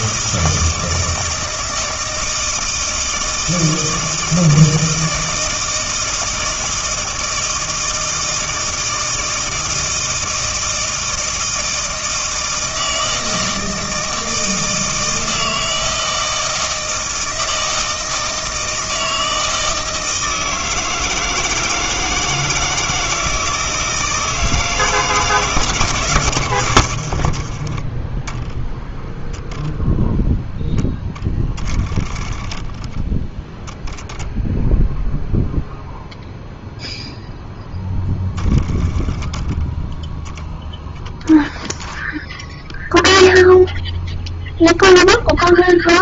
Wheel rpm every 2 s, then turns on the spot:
160, 160, 160, 160, 160, 160, 160, 160, 160, 160, 160, 160, 160, 90, 0, 0, 10, 0, 0, 20, 0, 0, 0.
none